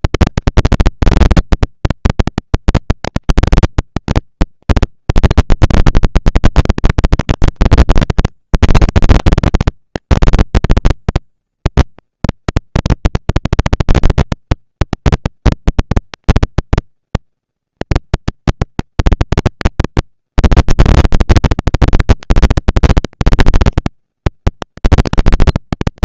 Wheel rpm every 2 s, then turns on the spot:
230, 230, 230, 200, 190, 210, 230, 230, 230, 240, 230, 230, 240.
none